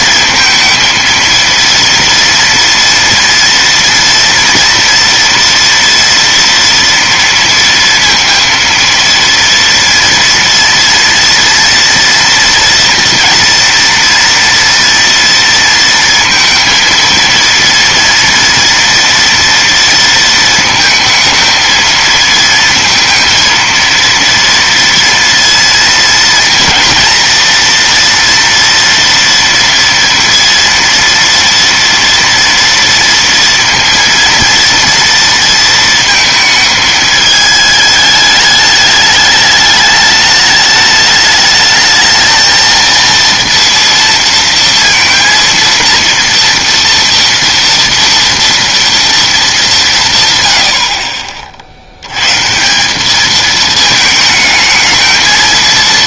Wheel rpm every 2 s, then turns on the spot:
230, 230, 230, 230, 230, 230, 230, 230, 230, 230, 230, 230, 230, 230, 230, 230, 230, 230, 220, 210, 210, 230, 230, 230, 230, 90, 160, 220.
none